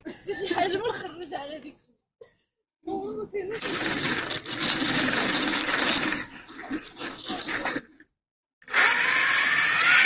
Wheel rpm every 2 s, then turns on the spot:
0, 0, 10, 20, 60.
4-8